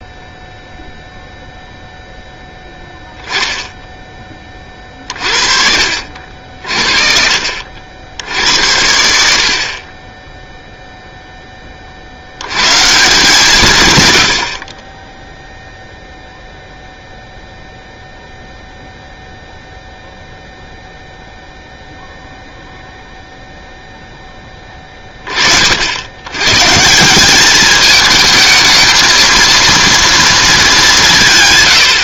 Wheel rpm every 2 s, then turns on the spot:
0, 10, 30, 50, 80, 0, 110, 60, 0, 0, 0, 0, 10, 120, 220, 210.
none